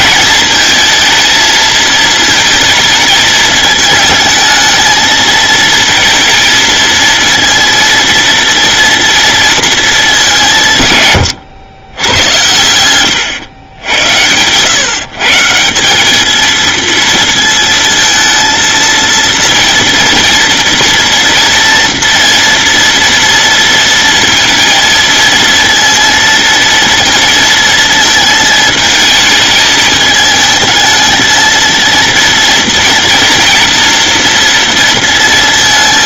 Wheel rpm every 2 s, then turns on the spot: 230, 220, 220, 230, 230, 140, 100, 130, 230, 230, 230, 230, 230, 230, 220, 220, 230, 230.
none